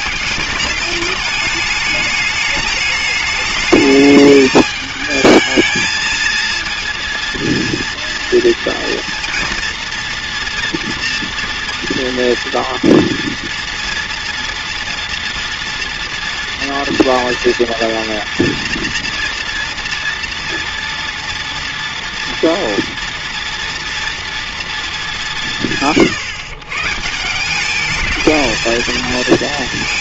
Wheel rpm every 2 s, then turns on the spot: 210, 210, 210, 230, 230, 230, 230, 230, 230, 230, 230, 230, 230, 140, 220.
none